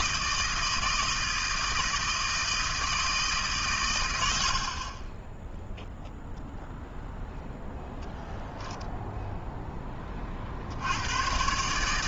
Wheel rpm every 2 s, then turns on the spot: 160, 160, 50, 0, 0, 60.
none